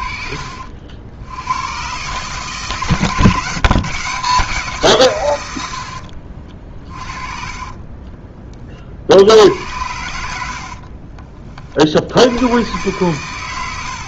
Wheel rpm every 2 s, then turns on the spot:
60, 140, 160, 40, 40, 60, 110.
10-12